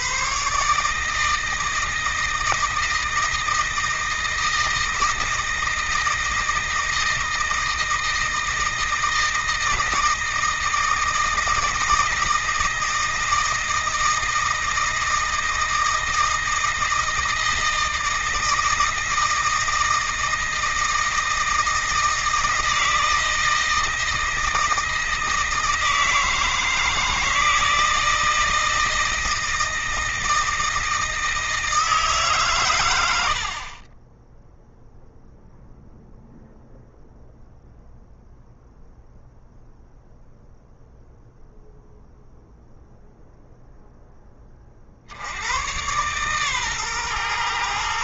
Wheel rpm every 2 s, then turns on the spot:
150, 160, 160, 160, 160, 160, 160, 160, 160, 160, 160, 160, 160, 160, 160, 160, 90, 0, 0, 0, 0, 0, 50, 120.
none